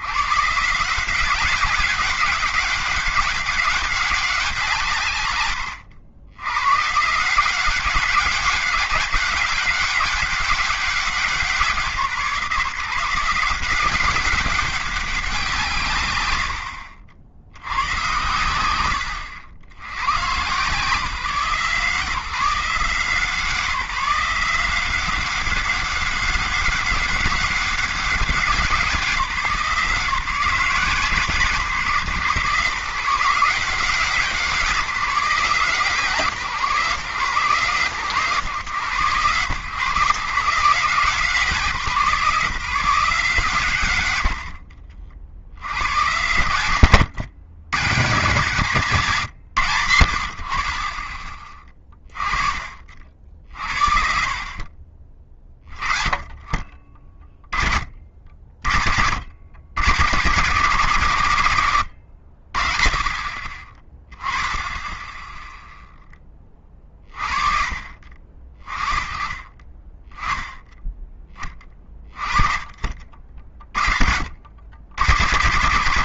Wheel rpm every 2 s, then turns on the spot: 140, 190, 180, 110, 200, 200, 160, 200, 90, 110, 140, 160, 180, 200, 190, 170, 150, 180, 150, 130, 150, 170, 50, 110, 150, 60, 30, 50, 30, 50, 130, 50, 10, 30, 40, 10, 30, 80.
16-20